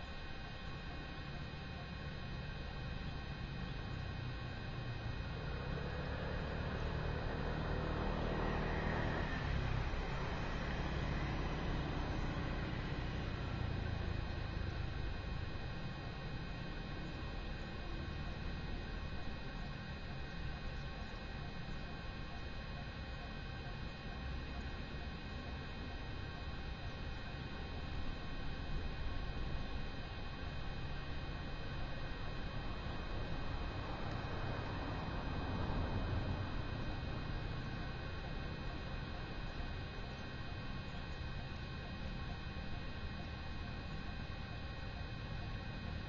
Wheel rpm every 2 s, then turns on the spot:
0, 0, 0, 0, 0, 0, 0, 0, 0, 0, 0, 0, 0, 0, 0, 0, 0, 0, 0, 0, 0, 0, 0.
none